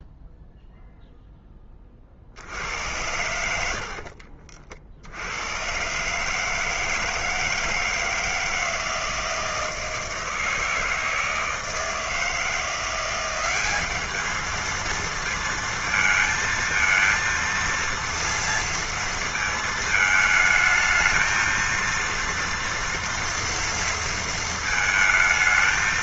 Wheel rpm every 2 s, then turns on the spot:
0, 70, 50, 150, 160, 160, 160, 210, 220, 230, 220, 230, 230.
4-6